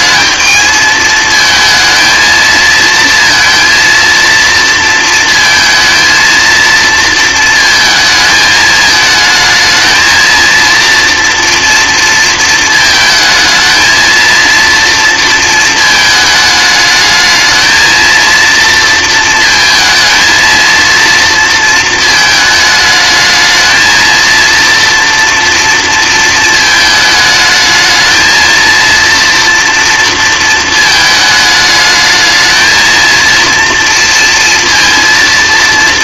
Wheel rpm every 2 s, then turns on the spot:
220, 230, 230, 230, 220, 230, 230, 230, 210, 230, 230, 220, 230, 220, 220, 220, 220, 230.
none